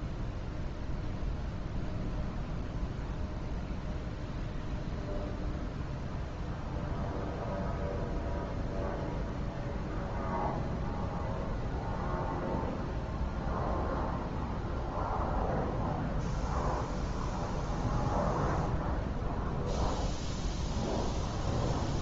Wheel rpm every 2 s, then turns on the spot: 0, 0, 0, 0, 0, 0, 0, 0, 0, 0, 0.
none